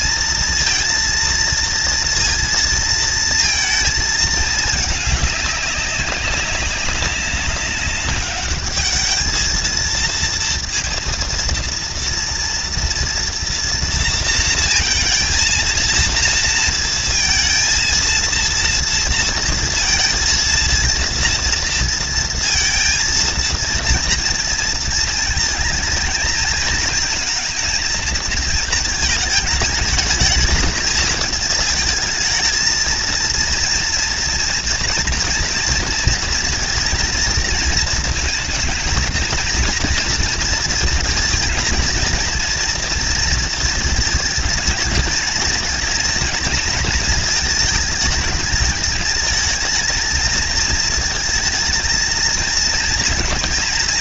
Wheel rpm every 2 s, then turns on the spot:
230, 230, 220, 200, 200, 230, 230, 230, 230, 230, 230, 230, 230, 220, 220, 210, 220, 230, 230, 230, 230, 230, 220, 220, 220, 220, 220.
none